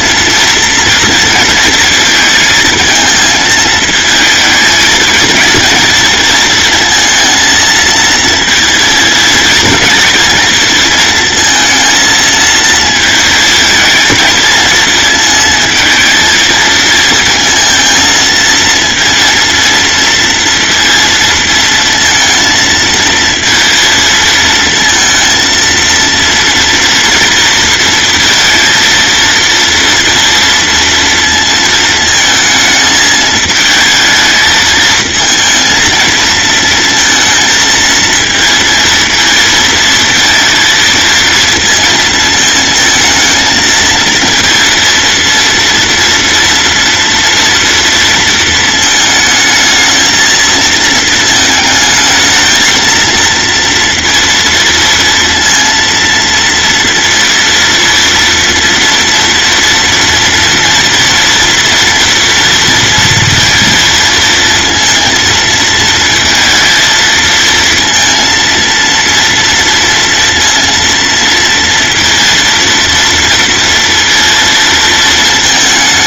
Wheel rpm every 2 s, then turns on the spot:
230, 230, 220, 230, 230, 230, 220, 220, 230, 230, 230, 230, 230, 230, 230, 230, 220, 220, 230, 230, 230, 220, 230, 230, 220, 230, 230, 230, 230, 230, 230, 230, 230, 220, 230, 230, 230, 230.
none